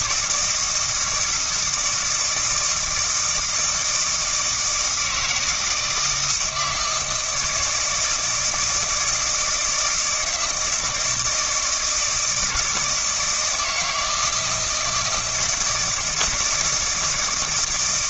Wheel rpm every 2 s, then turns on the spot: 160, 160, 160, 160, 160, 170, 160, 160, 160.
none